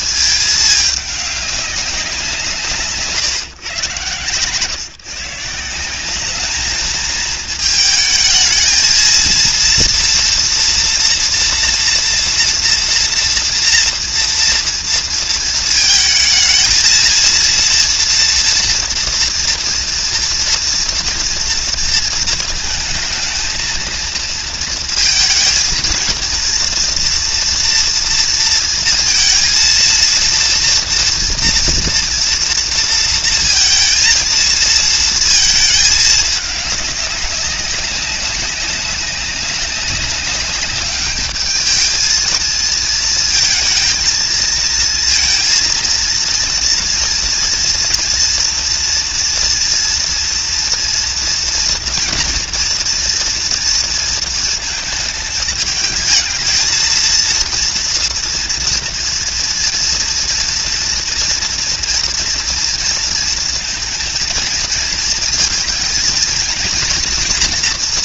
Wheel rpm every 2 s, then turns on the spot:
220, 170, 140, 210, 220, 240, 240, 240, 220, 230, 230, 220, 230, 230, 230, 230, 230, 230, 210, 200, 200, 220, 230, 240, 230, 240, 230, 230, 220, 230, 230, 230, 230, 230.
none